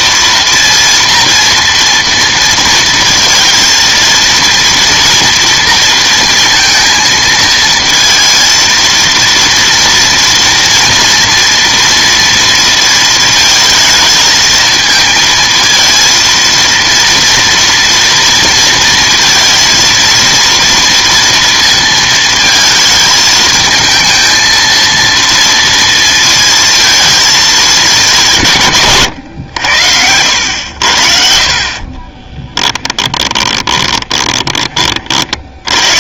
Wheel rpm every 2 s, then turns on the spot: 230, 230, 230, 230, 230, 230, 230, 220, 230, 230, 230, 220, 230, 220, 120, 70, 20, 30.
32-34